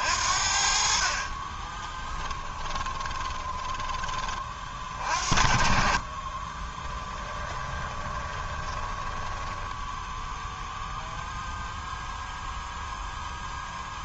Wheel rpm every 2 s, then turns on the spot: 50, 20, 40, 20, 20, 0, 0.
2-4 6-10